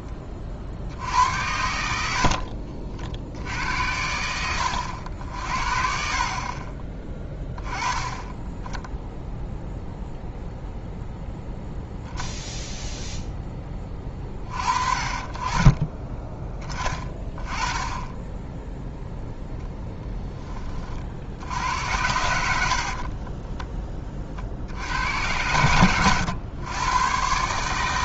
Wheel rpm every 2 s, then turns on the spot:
60, 50, 70, 10, 10, 0, 0, 40, 20, 0, 30, 50, 70, 120.
22-24